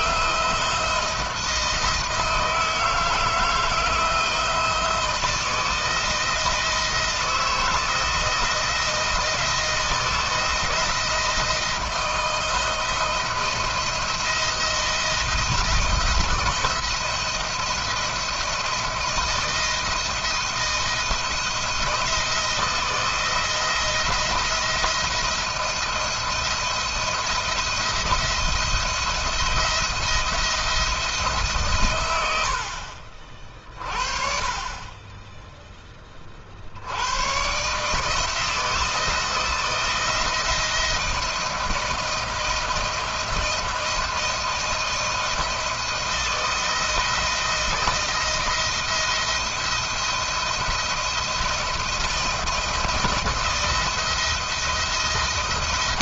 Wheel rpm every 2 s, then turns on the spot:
170, 160, 170, 170, 170, 160, 160, 170, 170, 170, 170, 160, 170, 170, 170, 170, 70, 30, 60, 170, 170, 160, 160, 170, 170, 170, 170, 170.
none